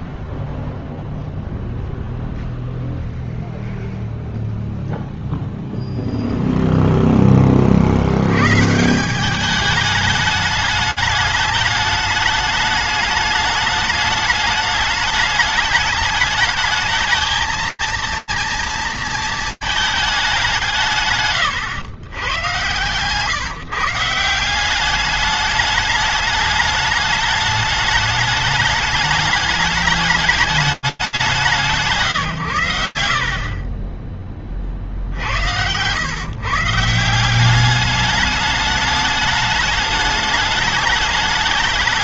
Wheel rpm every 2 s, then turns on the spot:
0, 0, 0, 130, 210, 210, 210, 220, 230, 180, 120, 180, 210, 210, 210, 110, 40, 140, 210, 210, 210.
none